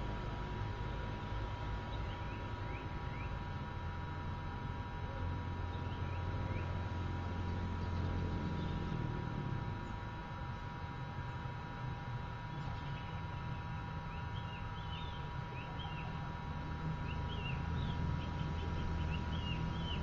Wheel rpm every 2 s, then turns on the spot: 0, 0, 0, 0, 0, 0, 0, 0, 0, 0.
none